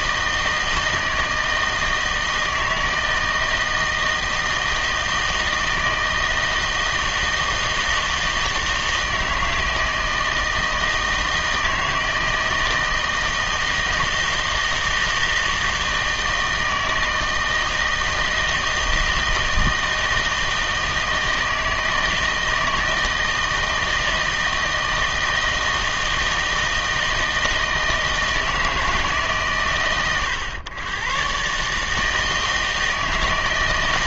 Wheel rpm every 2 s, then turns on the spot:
160, 160, 160, 160, 160, 160, 160, 160, 160, 160, 160, 160, 160, 160, 160, 110, 160.
none